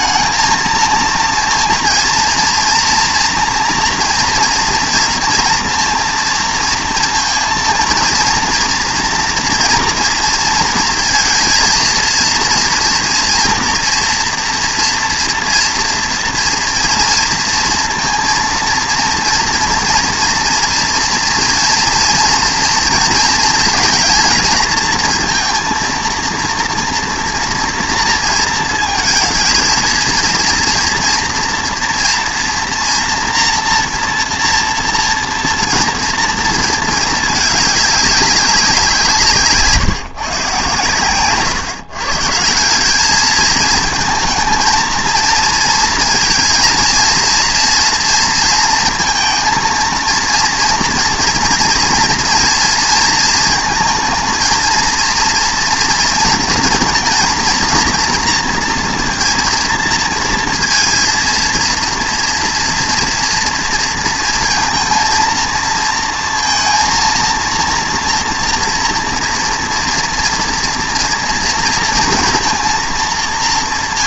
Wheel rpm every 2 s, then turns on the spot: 230, 240, 230, 230, 230, 230, 230, 240, 230, 230, 230, 240, 230, 230, 230, 230, 230, 230, 230, 190, 130, 180, 230, 230, 230, 230, 230, 220, 230, 240, 230, 230, 230, 230, 230, 230, 230.
none